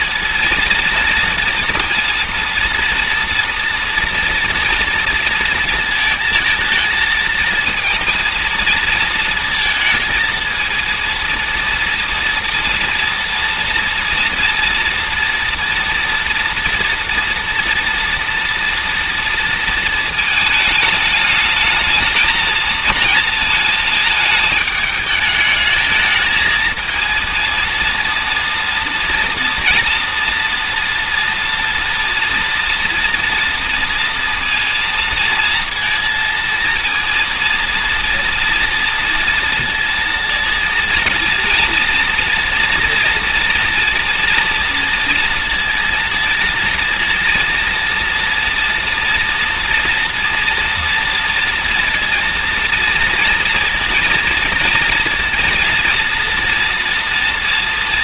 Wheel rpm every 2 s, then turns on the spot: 230, 230, 240, 220, 220, 230, 230, 230, 230, 240, 220, 230, 210, 220, 240, 240, 240, 230, 230, 230, 230, 230, 230, 230, 230, 230, 230, 230, 230.
none